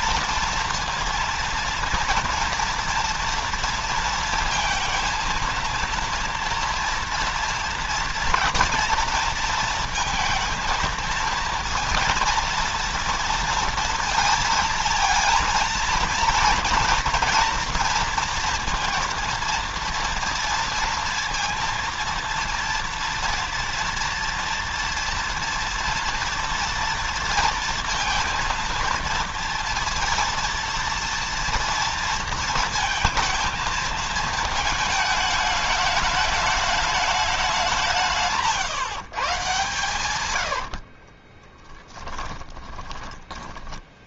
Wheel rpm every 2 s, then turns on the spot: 230, 230, 230, 230, 220, 230, 230, 230, 230, 230, 230, 230, 230, 230, 230, 230, 230, 220, 210, 140, 50, 20.
40-44